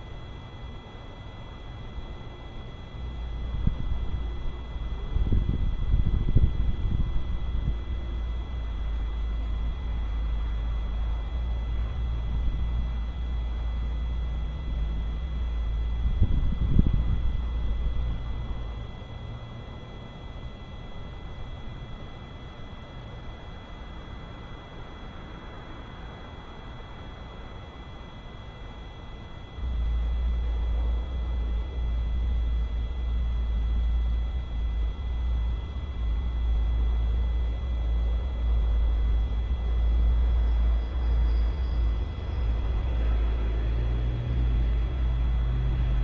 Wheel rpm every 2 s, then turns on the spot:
0, 0, 0, 0, 0, 0, 0, 0, 0, 0, 0, 0, 0, 0, 0, 0, 0, 0, 0, 0, 0, 0, 0.
none